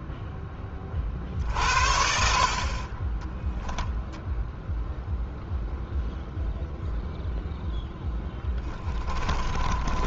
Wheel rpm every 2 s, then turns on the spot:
30, 40, 0, 0, 10.
8-10